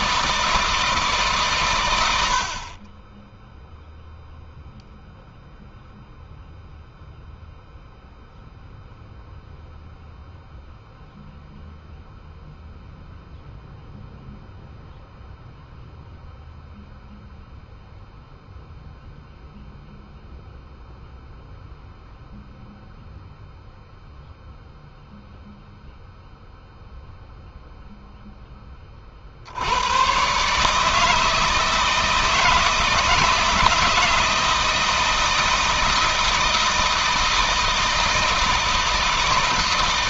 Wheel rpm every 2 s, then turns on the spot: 160, 40, 0, 0, 0, 0, 0, 0, 0, 0, 0, 0, 0, 0, 30, 150, 160, 160, 160, 160.
none